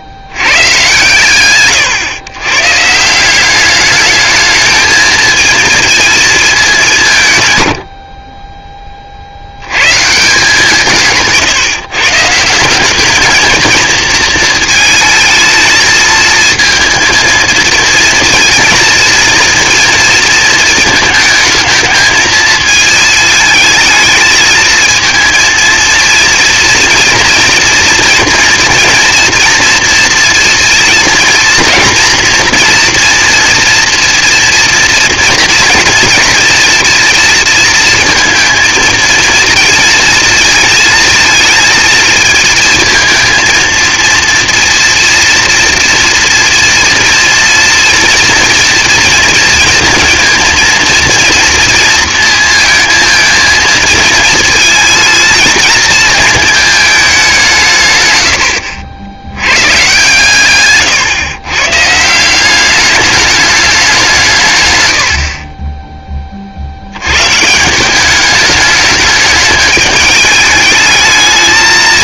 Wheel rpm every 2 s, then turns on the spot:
120, 140, 220, 200, 20, 160, 180, 220, 220, 240, 220, 220, 220, 230, 230, 230, 240, 230, 230, 230, 220, 230, 230, 240, 230, 230, 230, 220, 220, 70, 130, 200, 110, 60, 210, 210.
58-62